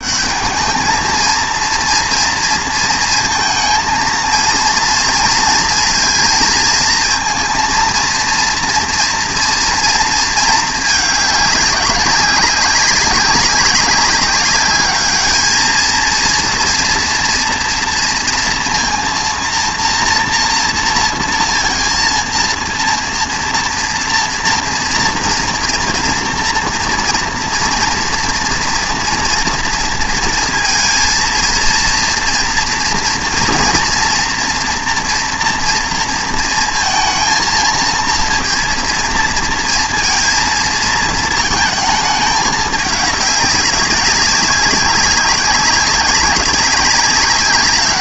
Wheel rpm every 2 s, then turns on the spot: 210, 230, 230, 230, 240, 210, 190, 210, 230, 230, 230, 230, 230, 230, 230, 230, 230, 240, 230, 230, 230, 210, 190, 200.
none